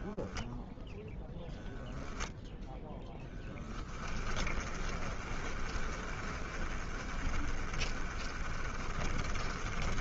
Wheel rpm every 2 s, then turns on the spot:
0, 10, 20, 20, 20.
2-10